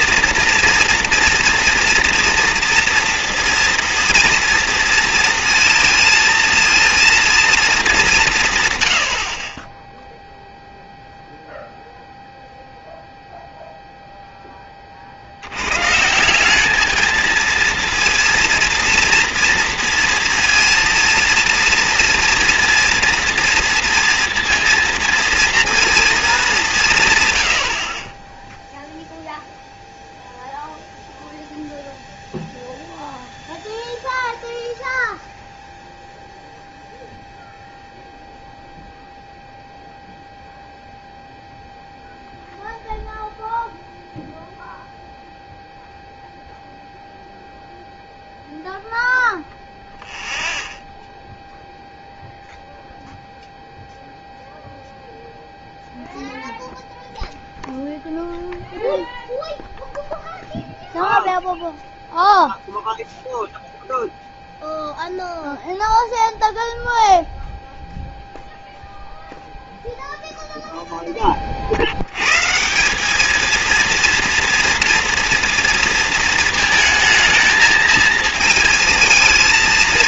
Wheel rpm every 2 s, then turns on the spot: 230, 230, 230, 230, 120, 0, 0, 20, 200, 230, 230, 240, 230, 190, 0, 0, 0, 0, 0, 0, 0, 0, 0, 0, 0, 0, 0, 0, 0, 0, 0, 0, 0, 0, 0, 0, 160, 230, 220, 220.
none